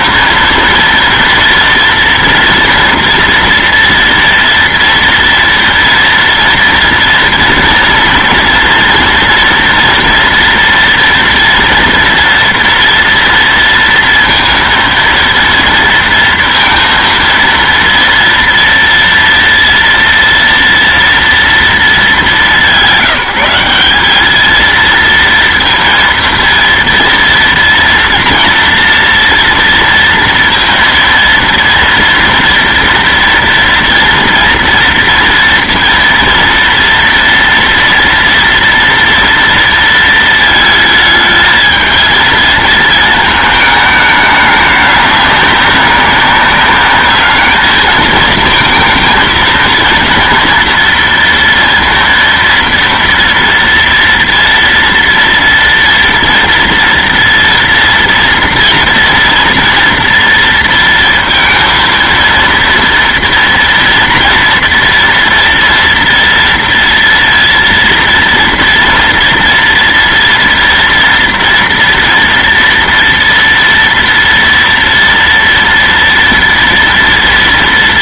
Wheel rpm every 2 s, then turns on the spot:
230, 230, 230, 230, 230, 230, 230, 230, 230, 230, 230, 190, 230, 230, 230, 230, 230, 230, 230, 230, 220, 220, 200, 200, 230, 230, 230, 230, 230, 230, 230, 230, 230, 230, 230, 230, 230, 230, 230.
none